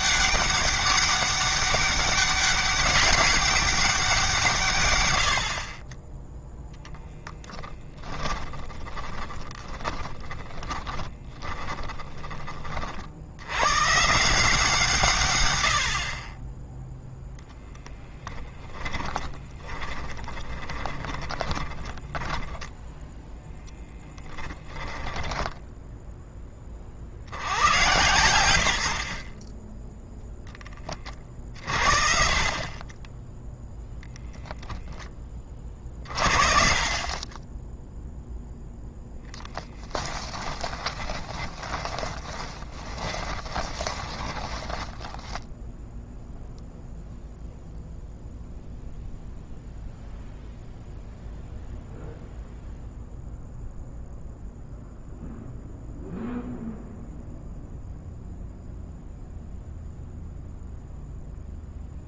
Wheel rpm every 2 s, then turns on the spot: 200, 200, 130, 0, 20, 10, 40, 160, 10, 20, 10, 0, 20, 40, 80, 20, 30, 10, 40, 0, 20, 20, 10, 0, 0, 0, 0, 0, 0, 0, 0.
8-12 18-22 24-26 40-46